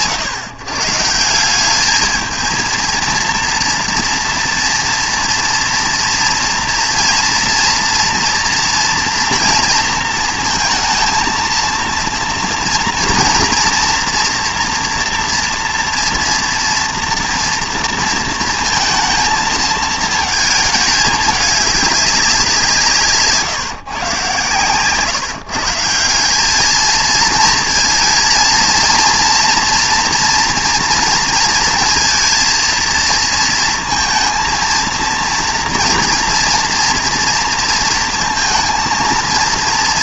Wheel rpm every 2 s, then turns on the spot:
150, 230, 230, 230, 230, 230, 240, 230, 230, 220, 220, 160, 140, 220, 230, 230, 230, 230, 230, 230.
24-26